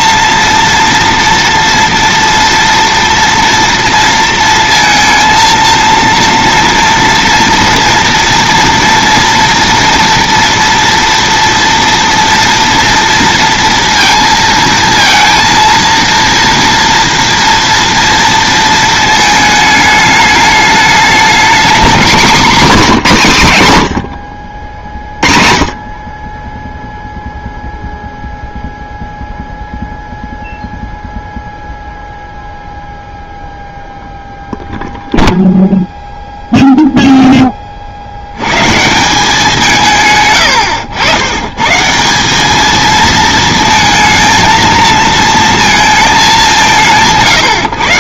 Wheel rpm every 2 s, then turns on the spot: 230, 240, 230, 230, 230, 230, 230, 230, 230, 220, 210, 220, 50, 10, 0, 0, 0, 0, 0, 130, 100, 210, 230, 170.
none